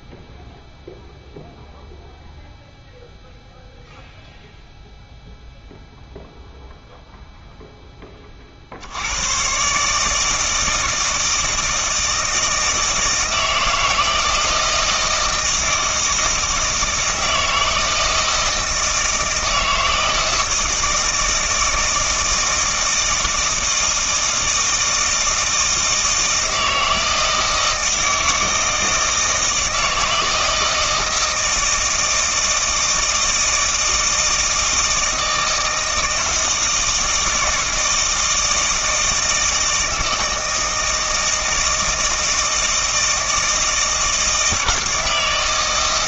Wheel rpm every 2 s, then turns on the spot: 0, 0, 0, 0, 60, 160, 160, 160, 160, 160, 160, 160, 160, 160, 160, 160, 160, 160, 160, 160, 160, 160, 160.
none